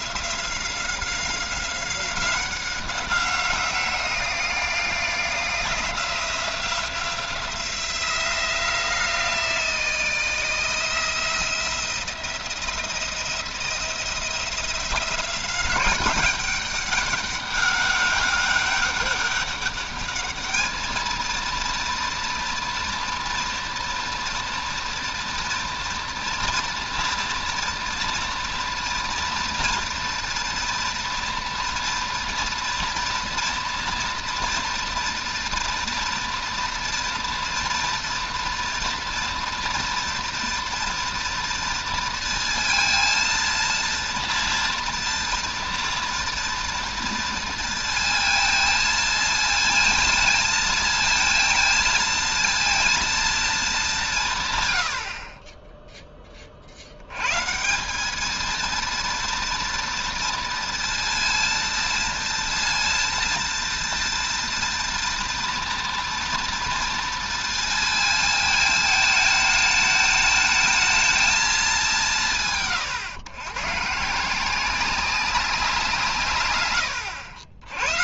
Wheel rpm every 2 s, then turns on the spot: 180, 190, 180, 180, 170, 160, 170, 180, 200, 200, 220, 240, 230, 230, 240, 230, 230, 230, 230, 230, 230, 230, 230, 230, 230, 220, 230, 110, 70, 230, 230, 230, 230, 230, 220, 220, 130, 180, 110.
none